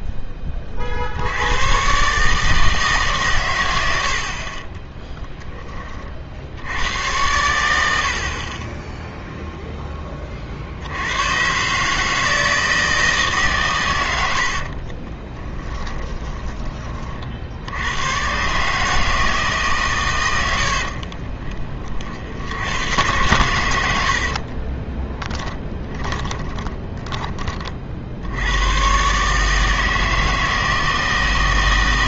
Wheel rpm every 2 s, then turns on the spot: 30, 160, 30, 90, 20, 60, 160, 50, 20, 150, 70, 90, 40, 30, 110, 160.
14-16 20-22 24-28